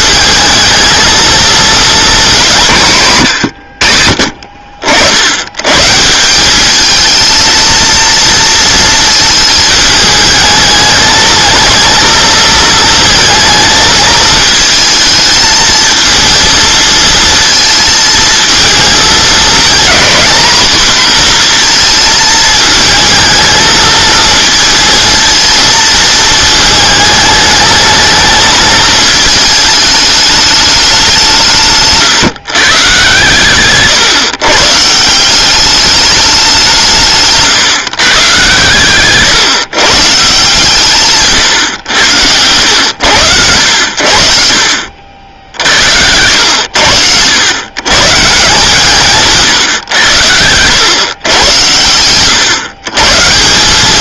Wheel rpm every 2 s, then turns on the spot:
220, 180, 60, 210, 230, 220, 230, 220, 230, 220, 240, 220, 230, 220, 220, 210, 130, 150, 190, 130, 140, 90, 60, 90, 160, 110, 130.
none